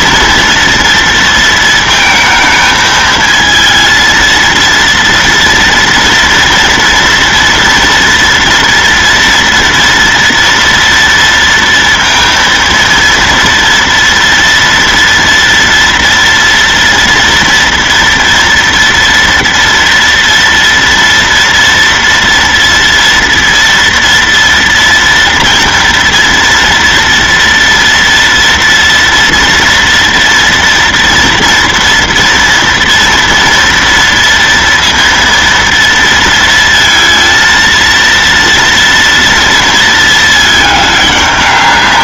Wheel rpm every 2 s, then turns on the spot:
230, 220, 230, 230, 240, 230, 230, 230, 240, 240, 230, 230, 230, 230, 230, 230, 240, 230, 230, 230, 210.
none